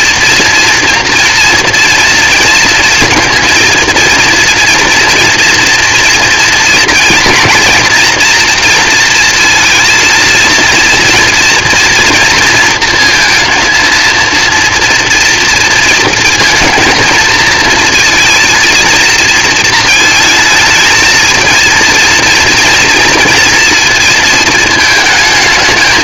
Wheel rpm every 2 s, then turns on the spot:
230, 230, 230, 230, 230, 230, 230, 230, 230, 230, 220, 230, 220.
none